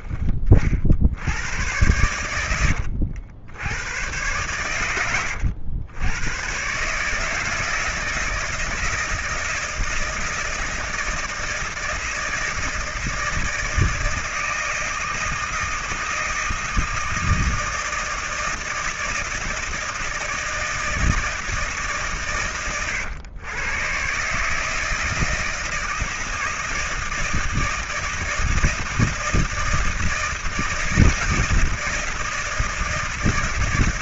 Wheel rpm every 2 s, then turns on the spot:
40, 90, 110, 120, 160, 160, 160, 160, 160, 160, 160, 120, 150, 160, 160, 160, 160.
none